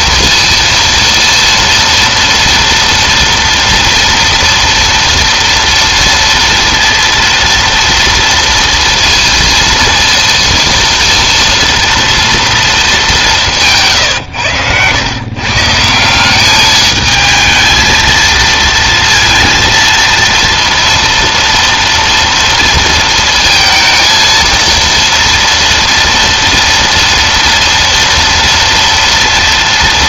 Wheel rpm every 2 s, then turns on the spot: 230, 230, 230, 230, 230, 230, 220, 120, 210, 230, 230, 230, 230, 230, 230.
none